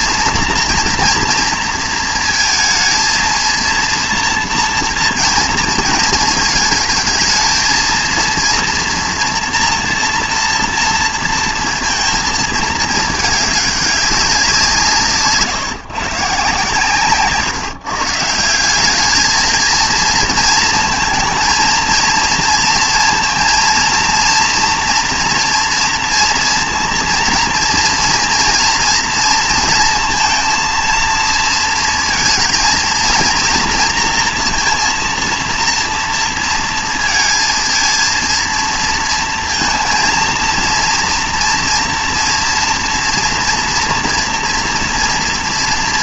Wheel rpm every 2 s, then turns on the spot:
240, 230, 230, 220, 230, 230, 220, 160, 140, 190, 220, 230, 230, 230, 230, 230, 230, 230, 230, 230, 230, 240, 230.
none